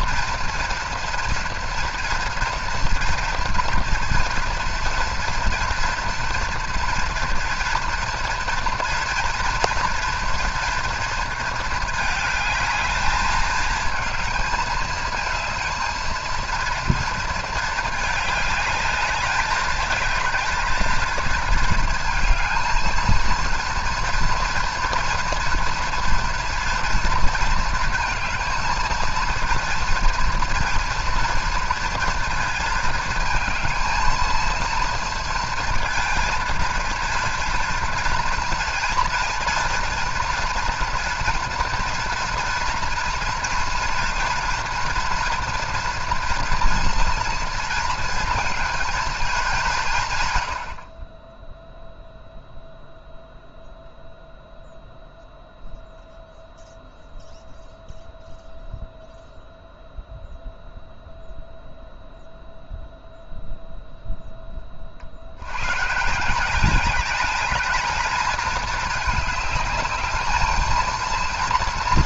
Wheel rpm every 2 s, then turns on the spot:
240, 230, 230, 230, 240, 230, 220, 220, 230, 210, 220, 220, 230, 230, 220, 240, 220, 230, 230, 230, 230, 230, 230, 230, 230, 80, 0, 0, 0, 0, 0, 0, 20, 180, 220, 220.
none